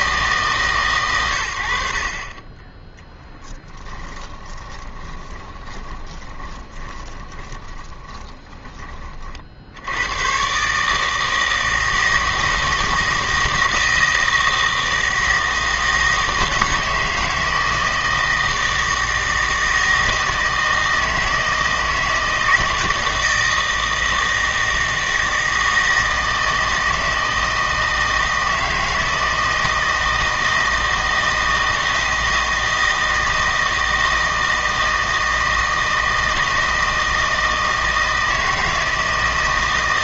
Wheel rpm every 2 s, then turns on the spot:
140, 20, 20, 20, 20, 140, 160, 160, 160, 160, 160, 160, 160, 160, 160, 160, 160, 160, 160, 160.
4-8